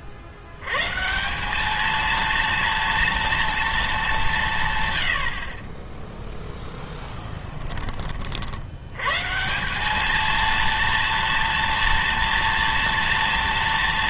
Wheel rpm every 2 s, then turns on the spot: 110, 230, 150, 0, 80, 230, 230.
none